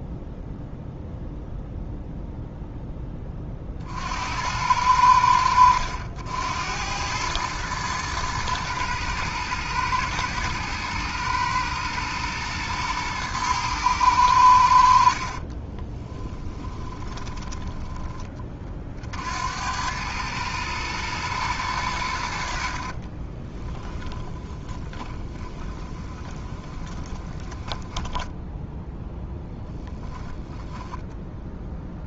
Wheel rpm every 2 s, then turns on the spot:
0, 10, 80, 90, 110, 110, 110, 80, 20, 40, 110, 50, 20, 20, 10, 0.
16-18 22-28